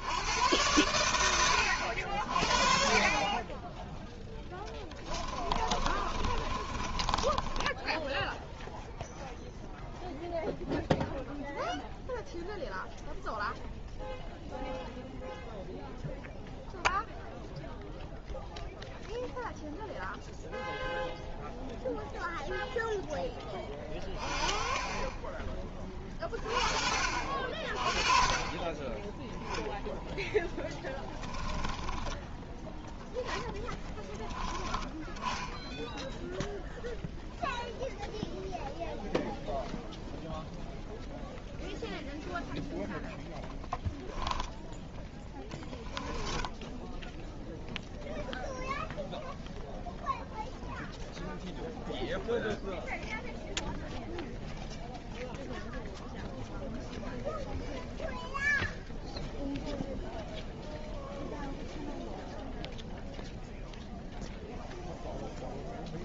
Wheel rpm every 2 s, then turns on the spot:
100, 40, 10, 30, 0, 0, 0, 0, 0, 0, 0, 0, 0, 40, 20, 10, 10, 20, 0, 0, 0, 0, 10, 10, 0, 0, 0, 0, 0, 0, 0, 0, 0.
4-8 30-32 46-48